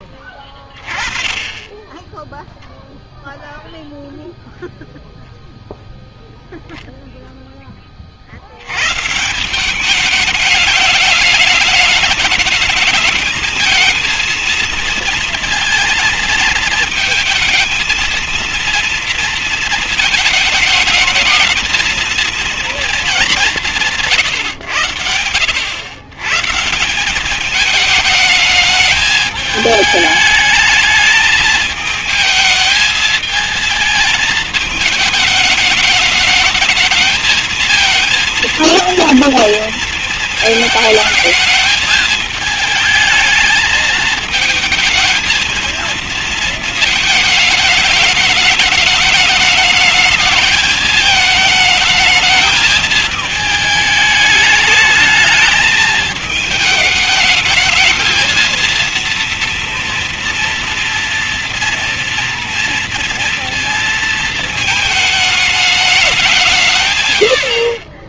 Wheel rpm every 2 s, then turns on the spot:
10, 0, 0, 0, 60, 210, 210, 220, 220, 230, 210, 230, 120, 130, 210, 210, 220, 220, 210, 230, 220, 220, 220, 230, 210, 220, 220, 210, 210, 230, 230, 230, 230, 180.
none